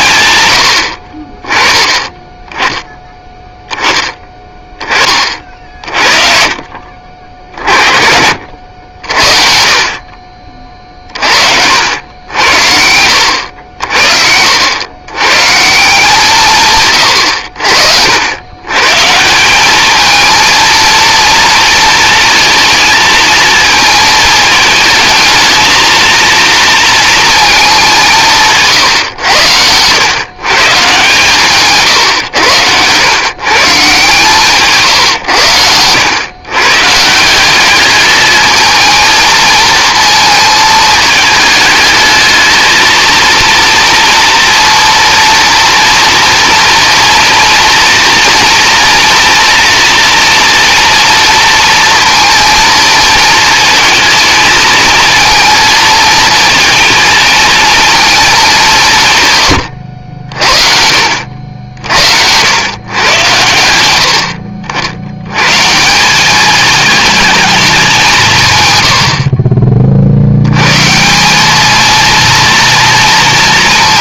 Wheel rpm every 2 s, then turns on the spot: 80, 10, 10, 40, 60, 40, 80, 70, 140, 120, 230, 220, 220, 230, 140, 140, 110, 130, 140, 220, 220, 230, 230, 230, 230, 230, 220, 220, 230, 180, 50, 110, 70, 210, 110, 130, 230.
28-30